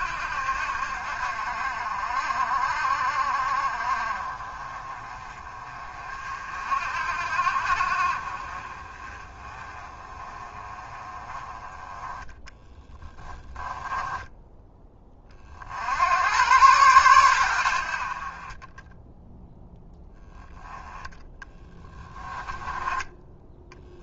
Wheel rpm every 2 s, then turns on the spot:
60, 50, 30, 50, 30, 20, 10, 20, 110, 10, 10, 10.
12-14 18-20